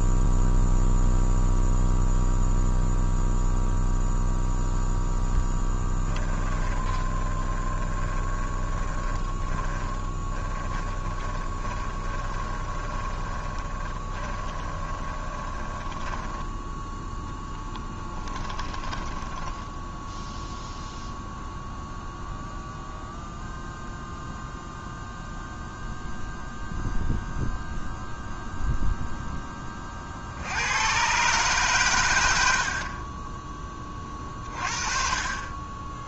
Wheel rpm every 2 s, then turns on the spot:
0, 0, 0, 20, 20, 20, 20, 20, 10, 10, 0, 0, 0, 0, 0, 80, 60, 30.
6-20